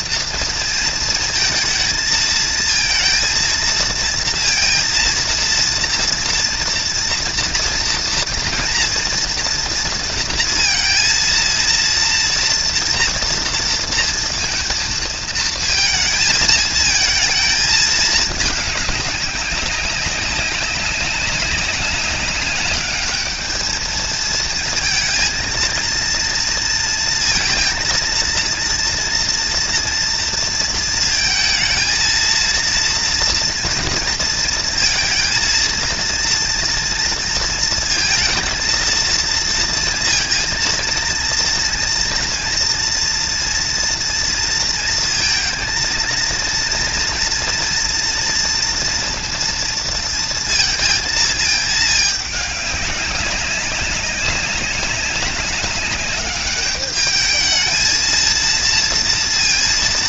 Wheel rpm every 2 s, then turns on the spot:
230, 220, 230, 230, 240, 230, 230, 230, 220, 210, 200, 210, 230, 230, 230, 230, 230, 230, 230, 230, 230, 230, 230, 230, 230, 230, 200, 190, 210, 230.
none